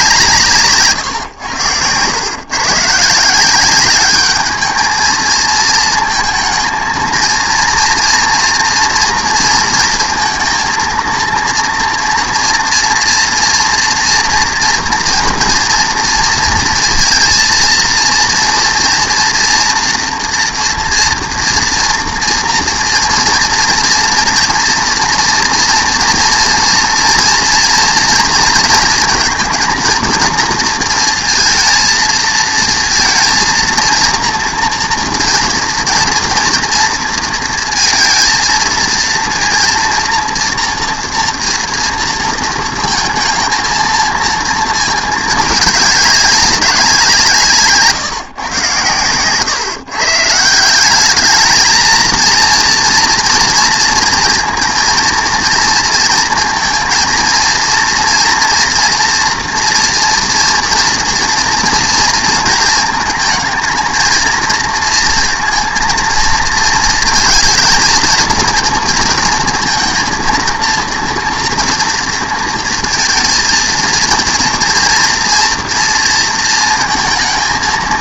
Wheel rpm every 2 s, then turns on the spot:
140, 130, 210, 230, 230, 230, 240, 230, 230, 230, 230, 230, 240, 230, 230, 230, 230, 230, 230, 230, 230, 220, 220, 180, 130, 170, 230, 230, 230, 230, 230, 230, 220, 230, 230, 230, 230, 230, 230.
none